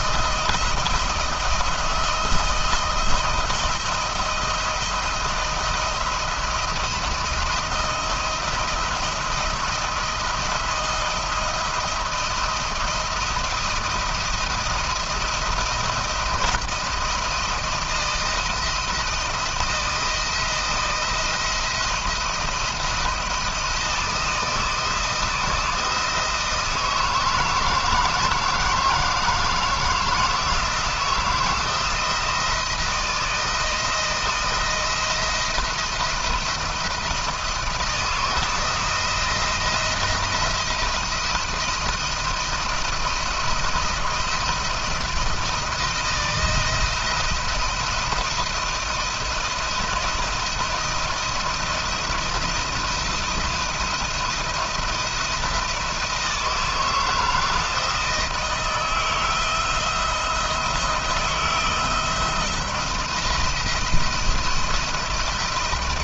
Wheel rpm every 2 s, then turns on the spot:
170, 170, 170, 170, 170, 170, 170, 170, 170, 170, 170, 170, 160, 160, 160, 160, 160, 170, 170, 170, 170, 170, 170, 160, 170, 160, 170, 170, 160, 160, 170, 170, 170.
none